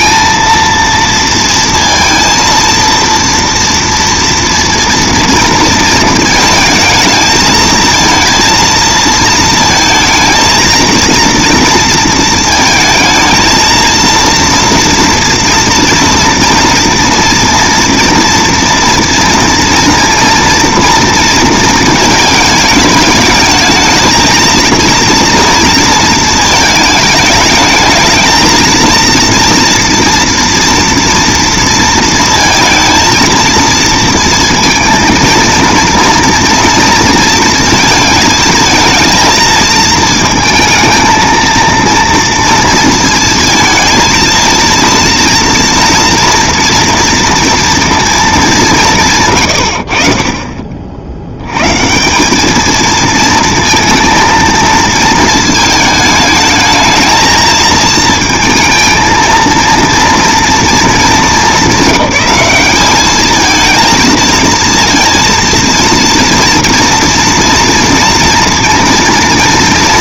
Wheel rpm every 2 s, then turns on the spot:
230, 230, 230, 220, 230, 230, 220, 230, 230, 230, 230, 220, 230, 210, 230, 230, 230, 230, 230, 220, 230, 230, 230, 230, 130, 70, 220, 220, 220, 230, 220, 210, 230, 230, 230.
none